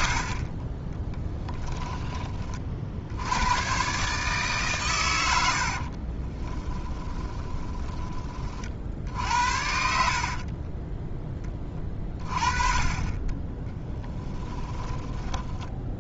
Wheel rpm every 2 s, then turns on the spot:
20, 60, 120, 10, 50, 10, 20, 10.
6-8 10-12 14-16